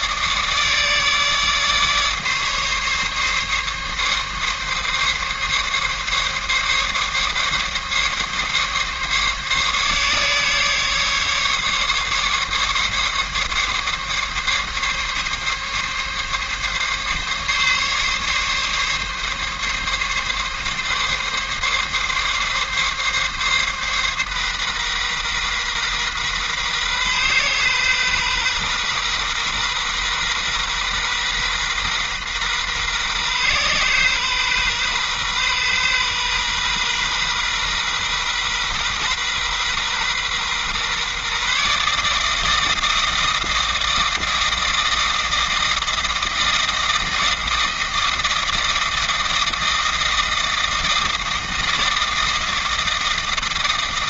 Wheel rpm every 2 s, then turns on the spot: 150, 140, 140, 140, 140, 140, 140, 140, 140, 140, 140, 140, 130, 130, 130, 130, 130, 130, 130, 130, 130, 160, 160, 160, 160, 160, 160.
none